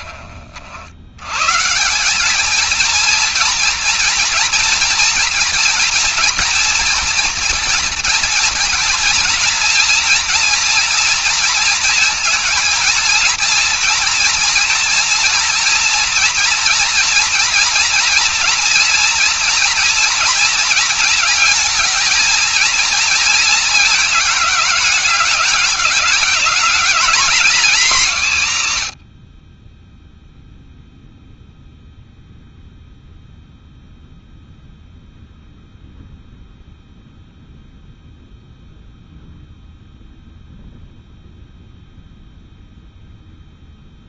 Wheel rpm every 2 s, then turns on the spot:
80, 230, 230, 230, 230, 230, 230, 230, 240, 230, 220, 230, 210, 220, 100, 0, 0, 0, 0, 0, 0, 0.
none